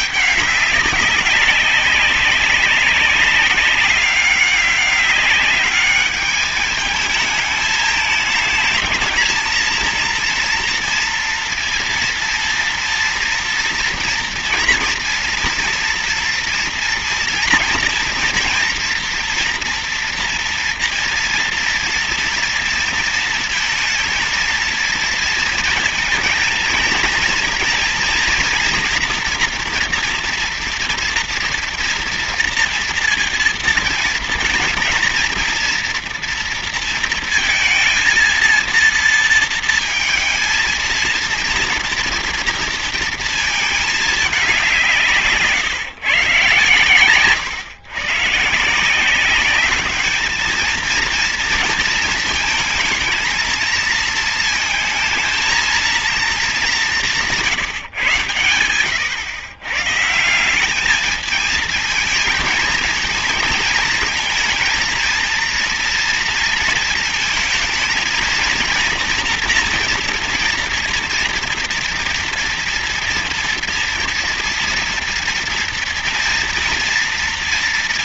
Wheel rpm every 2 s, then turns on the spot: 210, 190, 200, 210, 220, 230, 230, 230, 230, 230, 240, 230, 230, 230, 230, 240, 230, 230, 230, 230, 230, 230, 190, 130, 150, 220, 220, 220, 200, 100, 180, 220, 230, 230, 220, 240, 240, 230, 230.
none